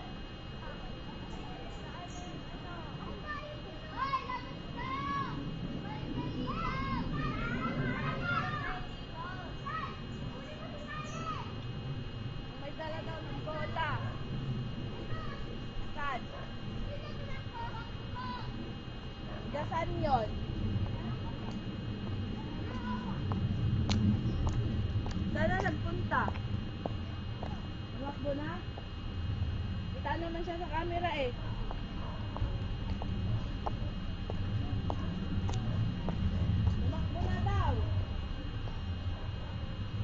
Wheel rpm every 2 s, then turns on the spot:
0, 0, 0, 0, 0, 0, 0, 0, 0, 0, 0, 0, 0, 0, 0, 0, 0, 0, 0, 0.
none